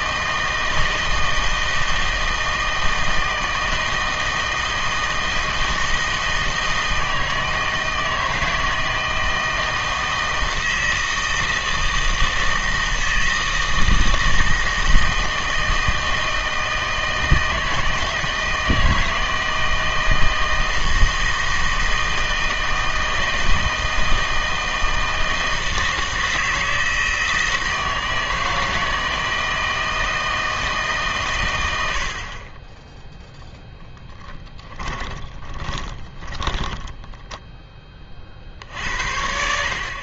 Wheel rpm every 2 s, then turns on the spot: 160, 160, 160, 160, 160, 160, 160, 160, 160, 160, 160, 160, 160, 160, 160, 160, 20, 10, 10, 60.
34-38